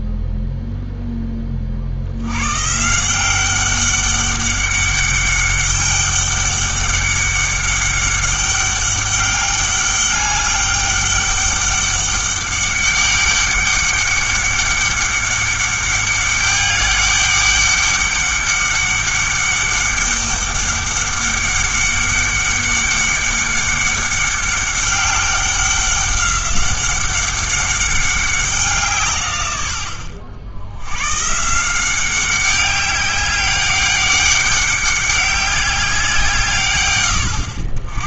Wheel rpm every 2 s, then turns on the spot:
0, 140, 200, 200, 200, 200, 200, 200, 200, 200, 200, 200, 200, 190, 170, 90, 200, 200, 120.
none